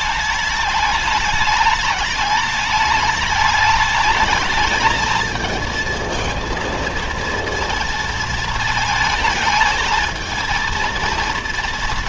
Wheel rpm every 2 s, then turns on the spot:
210, 210, 220, 230, 220, 230.
none